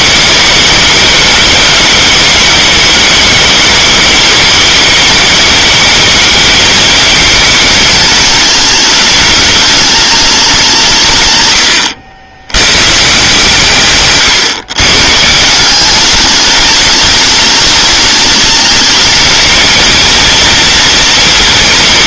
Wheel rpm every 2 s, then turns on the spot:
220, 210, 210, 220, 210, 190, 110, 130, 210, 210, 230.
none